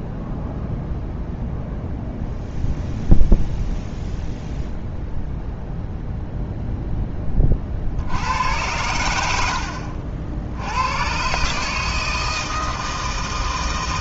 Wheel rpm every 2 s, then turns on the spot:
0, 0, 0, 10, 90, 100, 160.
none